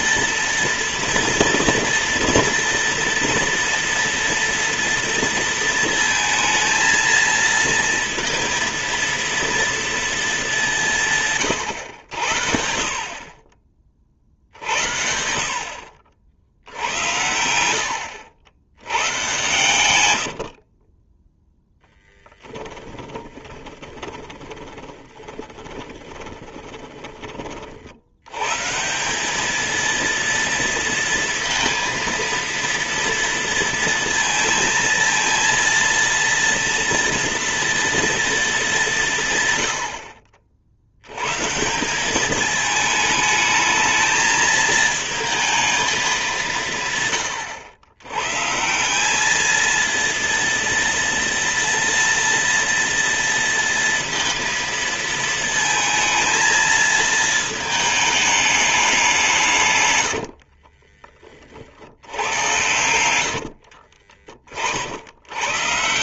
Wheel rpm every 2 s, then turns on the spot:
230, 230, 230, 230, 230, 190, 70, 50, 80, 100, 40, 10, 20, 20, 140, 230, 230, 220, 230, 210, 70, 220, 220, 160, 160, 230, 230, 230, 220, 210, 50, 90, 50.
20-28 60-64